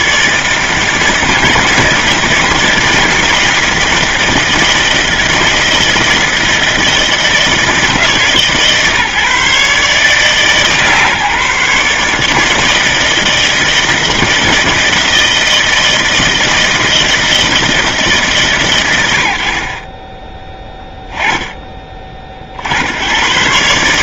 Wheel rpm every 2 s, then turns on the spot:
160, 160, 160, 160, 150, 150, 160, 160, 170, 100, 10, 60.
none